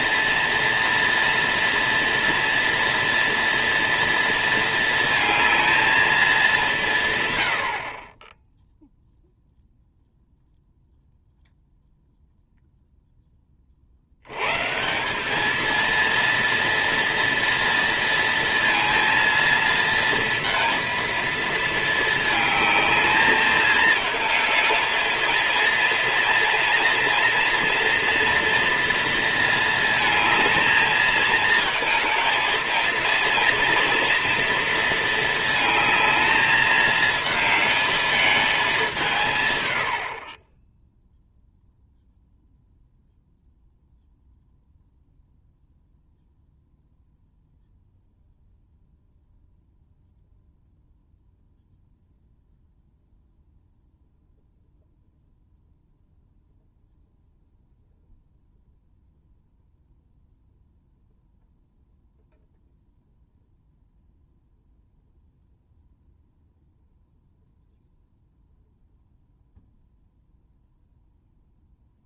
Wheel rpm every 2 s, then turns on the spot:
230, 230, 220, 160, 0, 0, 0, 180, 230, 220, 230, 220, 220, 230, 230, 220, 230, 230, 220, 170, 0, 0, 0, 0, 0, 0, 0, 0, 0, 0, 0, 0, 0, 0, 0, 0.
none